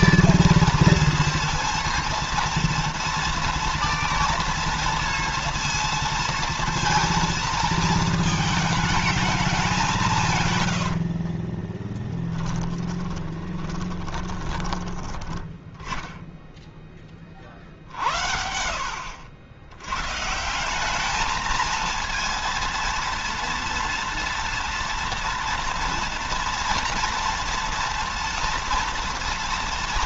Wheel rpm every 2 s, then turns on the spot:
230, 230, 230, 230, 220, 100, 10, 10, 10, 70, 190, 230, 240, 240, 230.
10-14